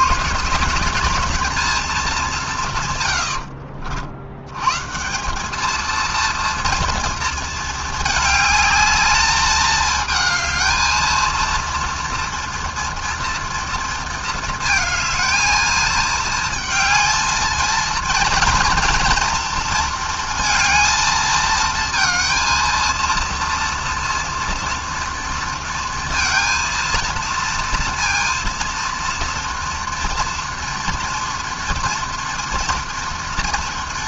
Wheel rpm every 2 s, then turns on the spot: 210, 70, 200, 220, 210, 230, 230, 220, 230, 230, 220, 230, 230, 230, 230, 230, 230.
2-4